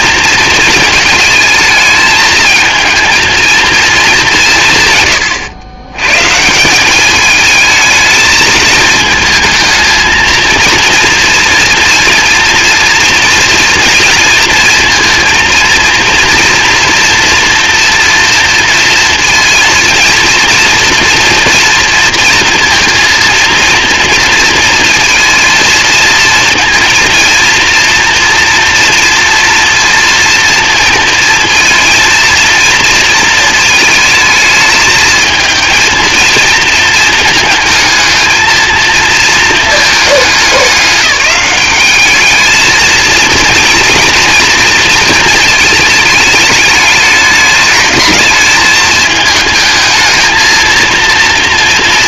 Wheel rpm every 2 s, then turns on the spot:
220, 230, 130, 200, 220, 230, 230, 230, 240, 230, 230, 230, 230, 230, 240, 230, 230, 220, 230, 230, 200, 220, 230, 210, 210, 230.
none